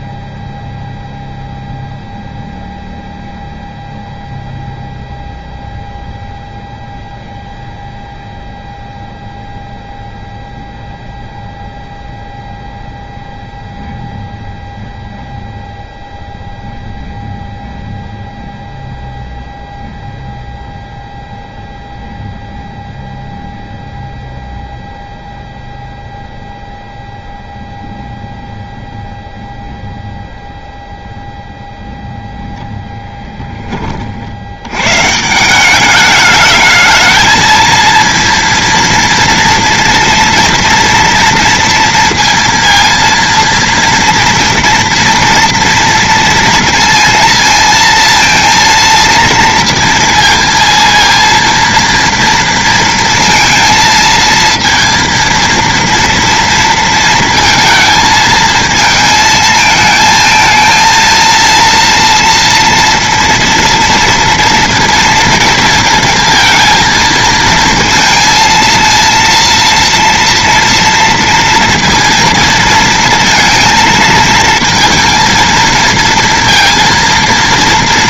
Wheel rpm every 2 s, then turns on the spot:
0, 0, 0, 0, 0, 0, 0, 0, 0, 0, 0, 0, 0, 0, 0, 0, 0, 110, 220, 230, 230, 230, 230, 230, 230, 230, 230, 230, 230, 220, 230, 230, 230, 230, 230, 230, 230, 230, 230.
none